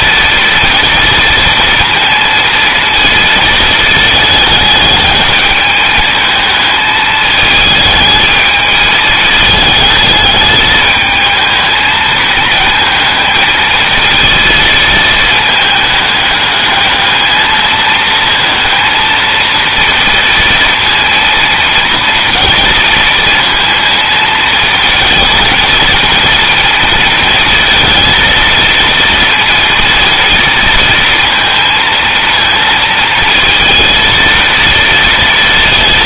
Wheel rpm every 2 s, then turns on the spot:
230, 230, 210, 220, 220, 210, 220, 220, 210, 230, 230, 230, 230, 230, 230, 230, 230, 230.
none